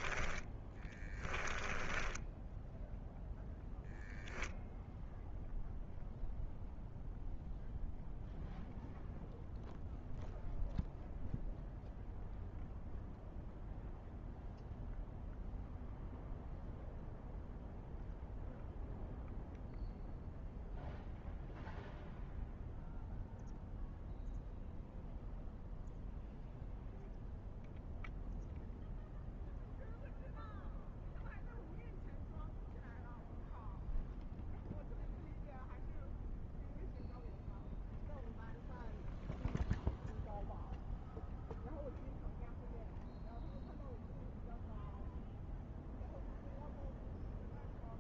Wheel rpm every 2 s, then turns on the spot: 10, 0, 0, 0, 0, 0, 0, 0, 0, 0, 0, 0, 0, 0, 0, 0, 0, 0, 0, 0, 0, 0, 0, 0.
0-2